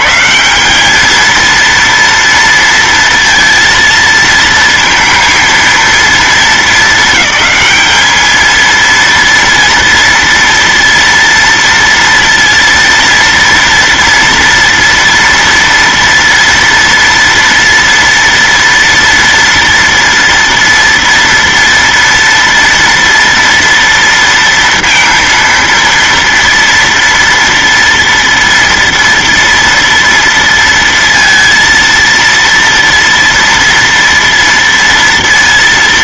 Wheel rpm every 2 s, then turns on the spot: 210, 230, 230, 220, 230, 230, 230, 230, 230, 230, 230, 230, 230, 230, 230, 230, 230, 230.
none